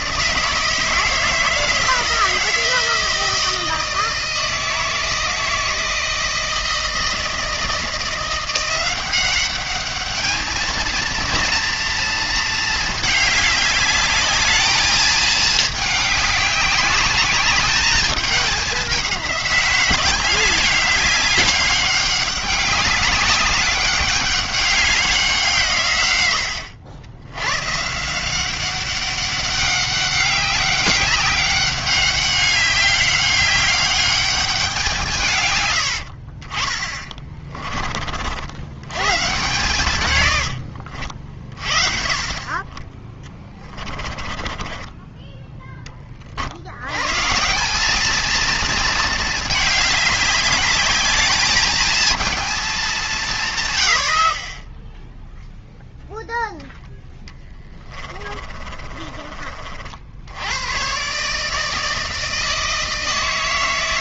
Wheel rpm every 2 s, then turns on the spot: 160, 160, 160, 160, 180, 230, 220, 220, 200, 200, 200, 200, 200, 100, 190, 200, 200, 180, 30, 110, 70, 30, 20, 90, 220, 200, 210, 10, 10, 30, 110, 160.
40-42 44-46 58-60